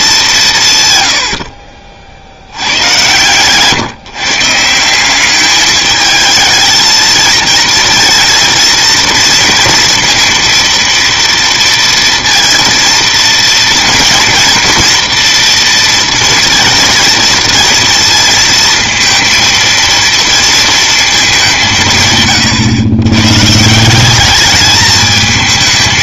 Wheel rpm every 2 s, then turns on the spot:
160, 100, 160, 220, 230, 230, 230, 230, 230, 230, 230, 120, 210.
none